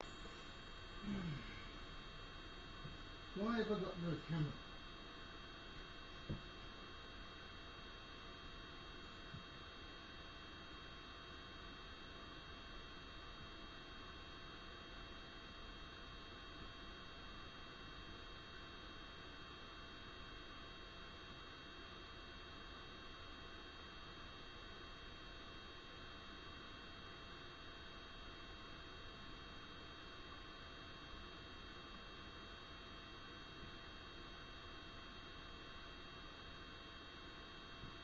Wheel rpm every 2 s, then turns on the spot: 0, 0, 0, 0, 0, 0, 0, 0, 0, 0, 0, 0, 0, 0, 0, 0, 0, 0, 0.
none